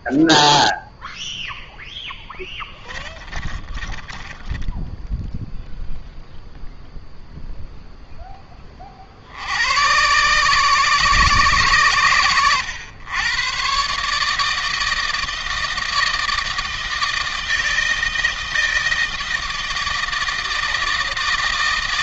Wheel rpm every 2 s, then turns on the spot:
0, 20, 10, 0, 30, 130, 100, 160, 160, 160, 160.
2-6